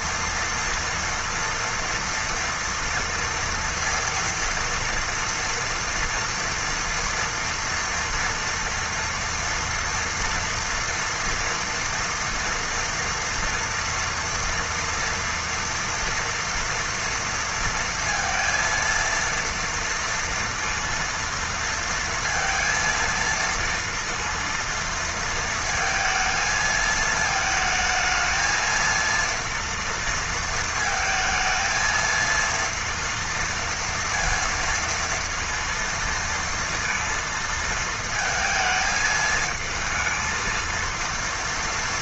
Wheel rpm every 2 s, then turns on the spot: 230, 230, 230, 230, 230, 230, 230, 240, 240, 230, 230, 230, 230, 220, 230, 230, 230, 230, 230, 220, 230.
none